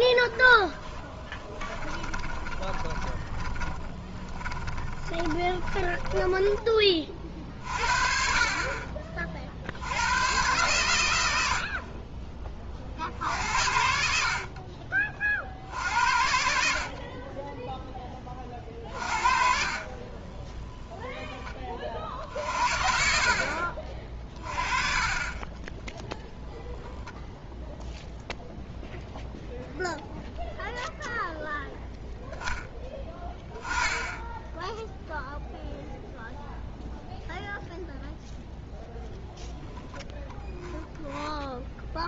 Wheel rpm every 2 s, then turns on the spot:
10, 20, 20, 20, 40, 120, 40, 50, 60, 40, 10, 50, 30, 0, 0, 0, 10, 0, 0, 0, 0.
0-6 18-22